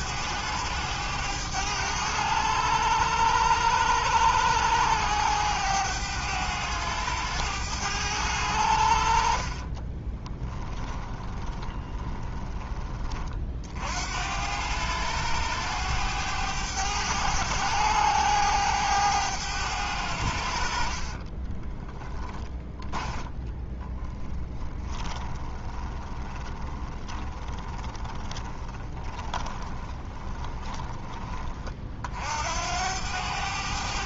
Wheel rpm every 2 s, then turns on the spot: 100, 100, 100, 100, 70, 20, 20, 100, 100, 100, 50, 10, 20, 10, 20, 20, 90.
10-12 20-22 24-30